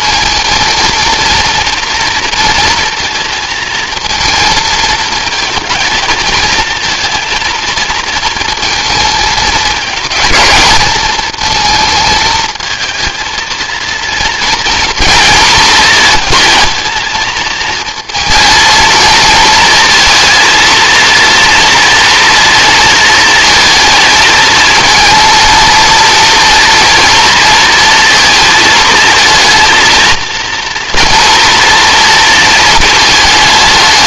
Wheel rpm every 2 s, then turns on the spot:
230, 230, 220, 230, 220, 210, 220, 230, 230, 230, 230, 230, 230, 230, 220, 230, 220.
none